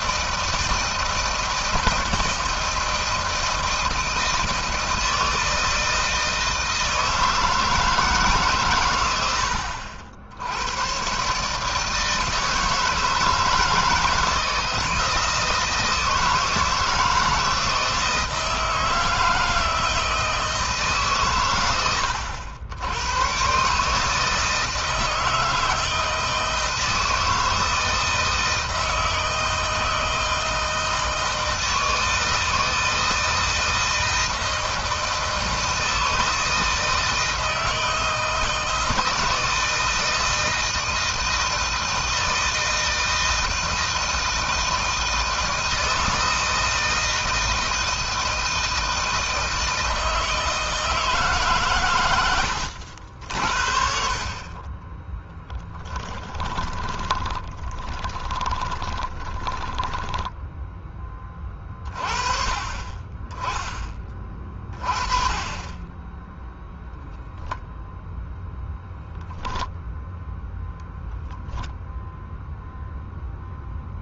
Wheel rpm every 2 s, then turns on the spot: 160, 160, 160, 160, 120, 100, 160, 160, 160, 160, 150, 80, 160, 160, 160, 160, 160, 160, 160, 160, 160, 160, 160, 160, 160, 160, 70, 30, 20, 20, 10, 30, 20, 0, 0, 0, 0.
54-60